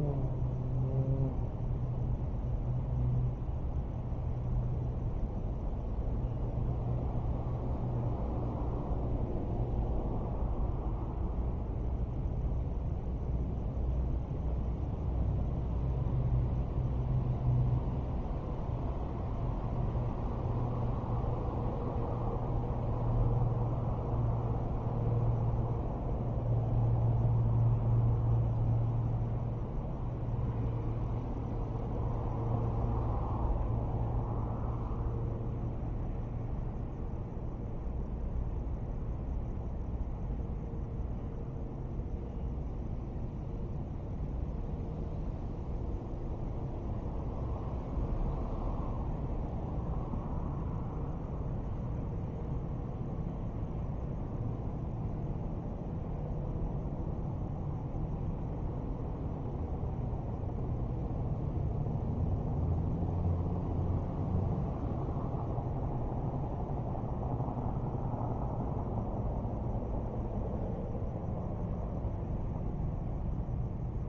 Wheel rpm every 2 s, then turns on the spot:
0, 0, 0, 0, 0, 0, 0, 0, 0, 0, 0, 0, 0, 0, 0, 0, 0, 0, 0, 0, 0, 0, 0, 0, 0, 0, 0, 0, 0, 0, 0, 0, 0, 0, 0, 0, 0.
none